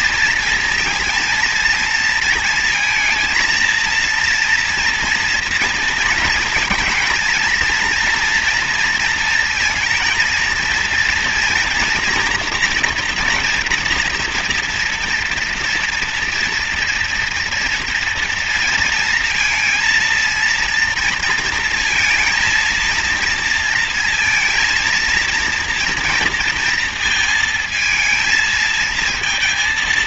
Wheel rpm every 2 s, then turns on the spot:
230, 230, 230, 230, 230, 230, 230, 230, 230, 230, 230, 230, 230, 230, 220.
none